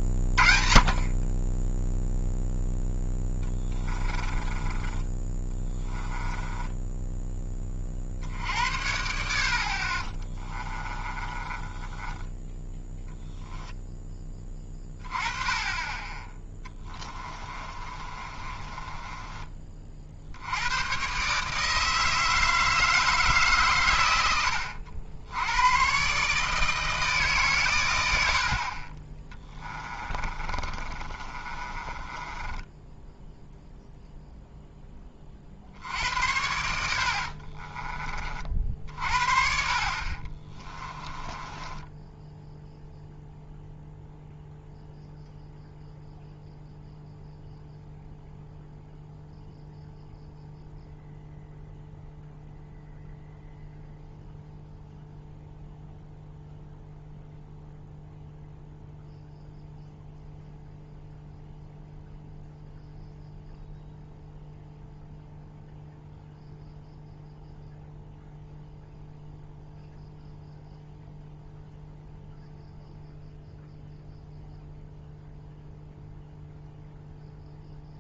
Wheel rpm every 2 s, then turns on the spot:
30, 0, 20, 10, 70, 20, 20, 20, 10, 30, 100, 160, 80, 160, 40, 30, 10, 10, 80, 40, 30, 0, 0, 0, 0, 0, 0, 0, 0, 0, 0, 0, 0, 0, 0, 0, 0, 0, 0.
4-8 10-12 16-20 30-34 40-42